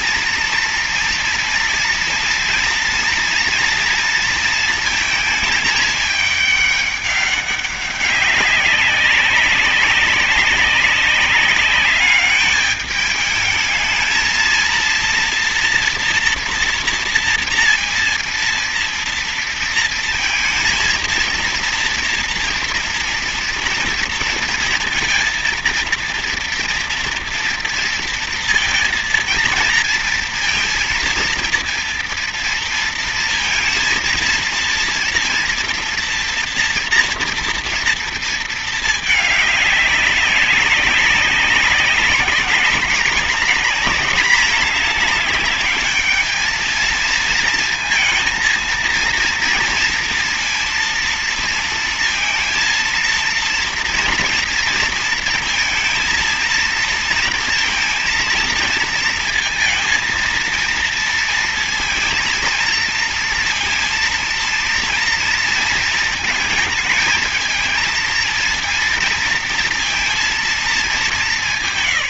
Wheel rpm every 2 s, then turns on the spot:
230, 230, 230, 210, 190, 190, 210, 230, 230, 230, 230, 230, 230, 230, 230, 230, 230, 230, 240, 230, 190, 200, 210, 220, 230, 230, 230, 230, 230, 230, 230, 230, 230, 220, 230, 220.
none